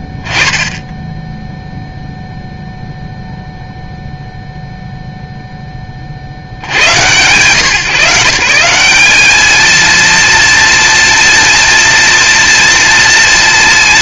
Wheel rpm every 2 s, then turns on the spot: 0, 0, 0, 30, 170, 230, 230.
none